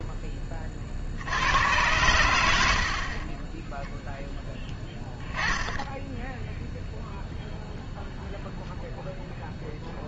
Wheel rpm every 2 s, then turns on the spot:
40, 70, 10, 0, 0.
none